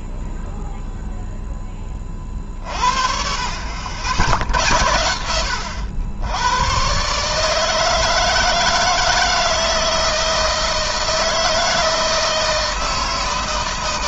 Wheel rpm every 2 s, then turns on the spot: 0, 40, 90, 130, 160, 160, 160.
none